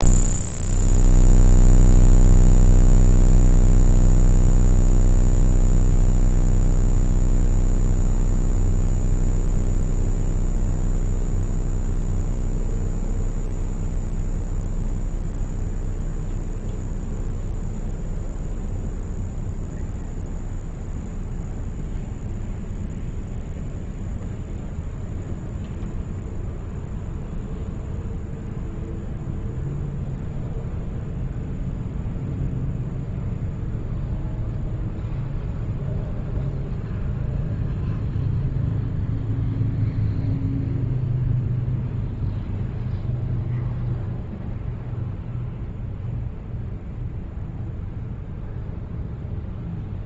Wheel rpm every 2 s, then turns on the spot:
0, 0, 0, 0, 0, 0, 0, 0, 0, 0, 0, 0, 0, 0, 0, 0, 0, 0, 0, 0, 0, 0, 0, 0, 0.
none